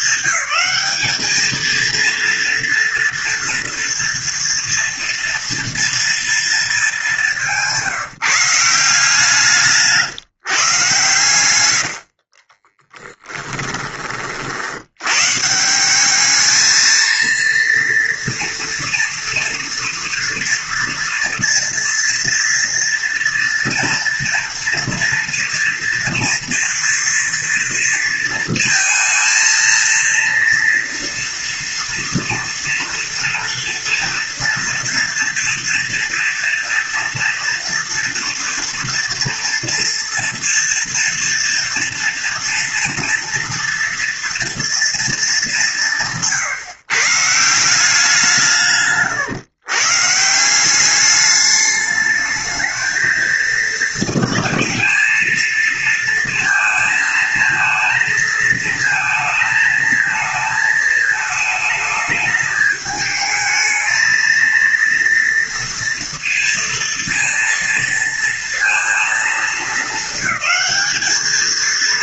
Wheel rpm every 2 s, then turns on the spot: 210, 230, 240, 210, 170, 150, 30, 90, 220, 230, 230, 230, 230, 230, 230, 240, 230, 230, 230, 230, 230, 230, 230, 160, 150, 190, 220, 220, 220, 230, 220, 220, 230, 230, 230, 200.
12-14